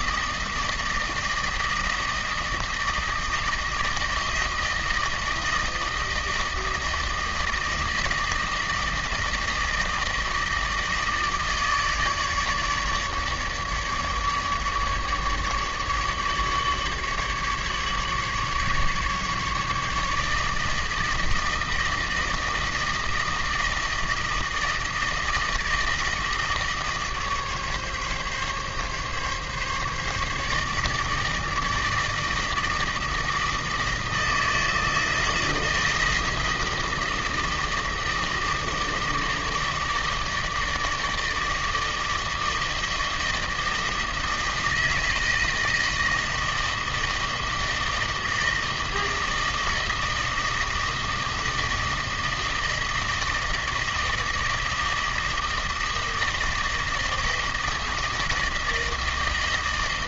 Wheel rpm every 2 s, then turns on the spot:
160, 160, 160, 160, 160, 160, 150, 150, 150, 150, 160, 160, 160, 160, 140, 150, 160, 160, 160, 160, 160, 160, 160, 160, 160, 160, 160, 160, 160, 160.
none